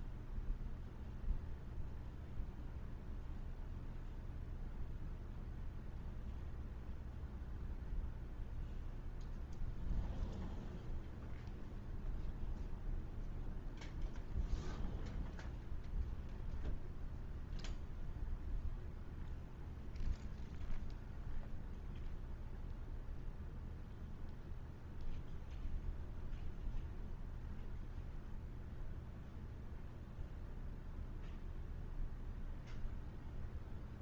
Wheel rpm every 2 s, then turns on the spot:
0, 0, 0, 0, 0, 0, 0, 0, 0, 0, 0, 0, 0, 0, 0, 0, 0.
none